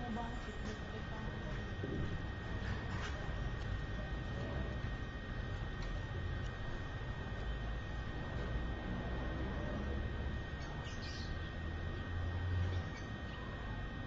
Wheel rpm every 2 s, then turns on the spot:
0, 0, 0, 0, 0, 0, 0.
none